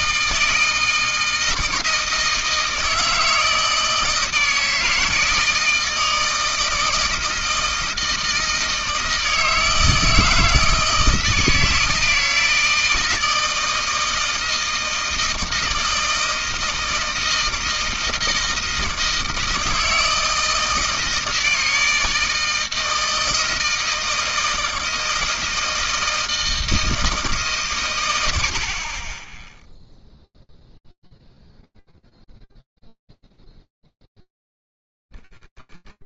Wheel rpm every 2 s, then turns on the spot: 160, 160, 160, 160, 160, 160, 160, 160, 160, 160, 160, 160, 160, 160, 110, 0, 0, 10.
none